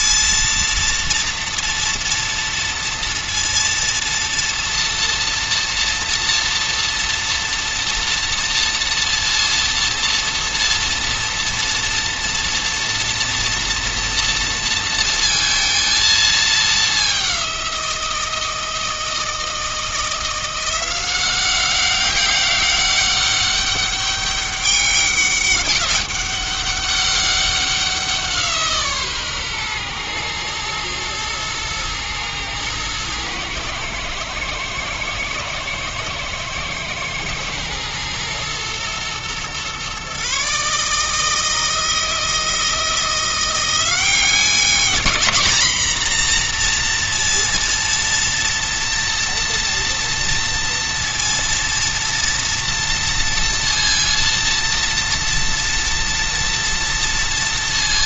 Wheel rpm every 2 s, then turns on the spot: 230, 230, 230, 230, 230, 230, 230, 230, 200, 160, 180, 200, 200, 200, 150, 120, 110, 110, 120, 120, 150, 170, 210, 240, 230, 240, 230, 230, 230.
none